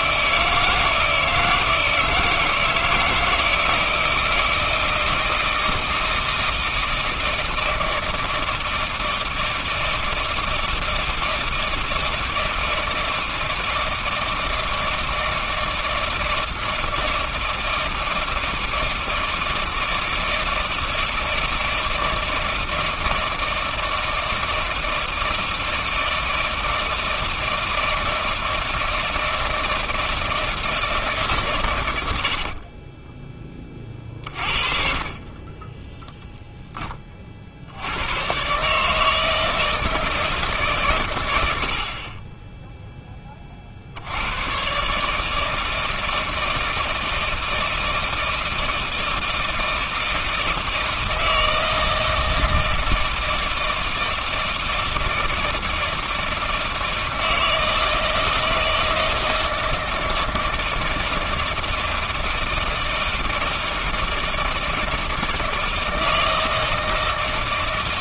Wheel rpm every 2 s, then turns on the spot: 160, 160, 160, 160, 160, 160, 160, 160, 160, 160, 160, 160, 160, 160, 160, 160, 50, 50, 10, 140, 140, 10, 120, 160, 160, 160, 160, 160, 160, 160, 160, 160, 160, 160.
34-36